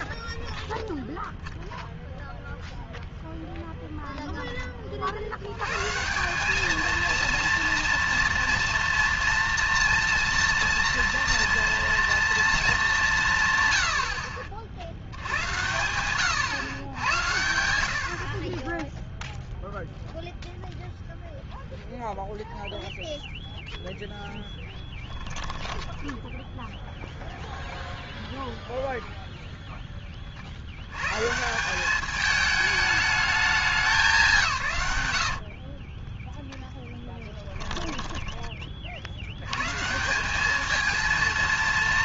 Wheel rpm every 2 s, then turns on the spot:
0, 0, 20, 210, 230, 240, 220, 70, 110, 30, 0, 0, 10, 0, 0, 70, 210, 140, 10, 30, 210.
none